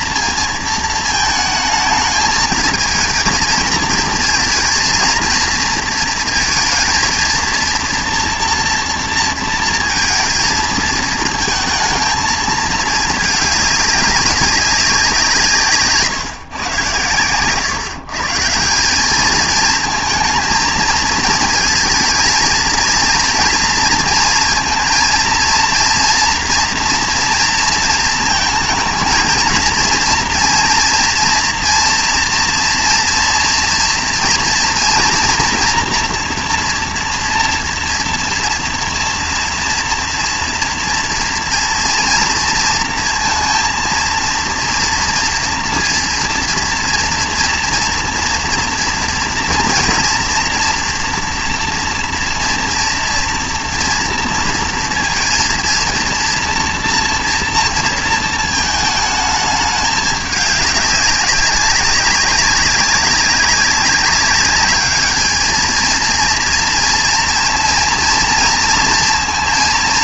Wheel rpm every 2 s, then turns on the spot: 230, 220, 230, 230, 240, 220, 220, 190, 120, 160, 220, 220, 230, 230, 220, 230, 230, 230, 240, 230, 230, 230, 230, 240, 230, 230, 240, 230, 230, 220, 200, 190, 200, 230, 230.
none